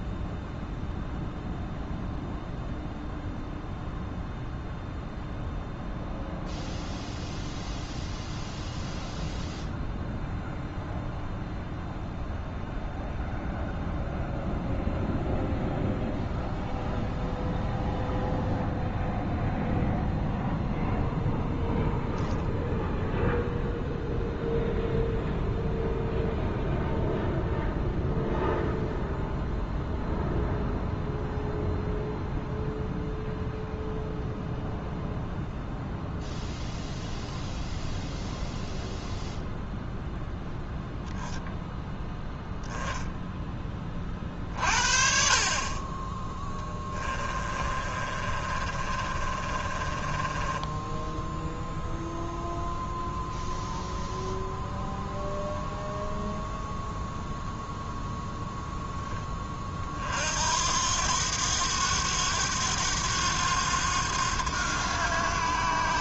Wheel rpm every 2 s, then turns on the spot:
0, 0, 0, 0, 0, 0, 0, 0, 0, 0, 0, 0, 0, 0, 0, 0, 0, 0, 0, 0, 0, 10, 40, 20, 30, 20, 0, 0, 0, 10, 80, 90, 90.
46-52